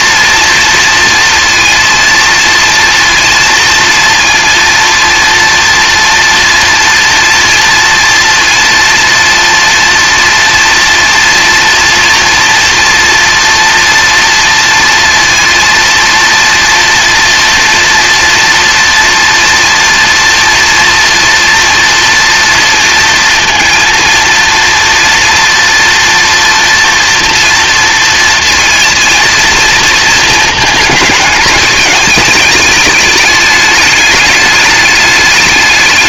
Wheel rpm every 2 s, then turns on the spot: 230, 230, 230, 230, 230, 240, 240, 230, 240, 230, 230, 230, 230, 240, 230, 220, 210, 210.
none